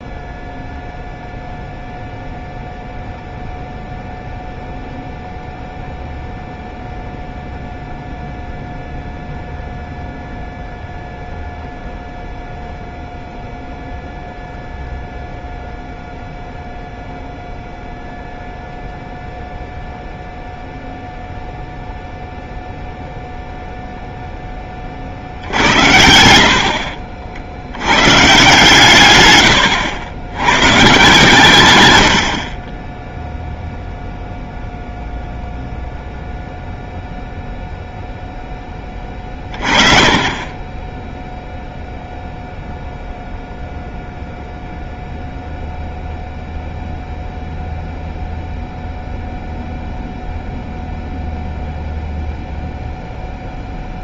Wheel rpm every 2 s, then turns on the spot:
0, 0, 0, 0, 0, 0, 0, 0, 0, 0, 0, 0, 10, 70, 140, 110, 30, 0, 0, 10, 20, 0, 0, 0, 0, 0, 0.
26-28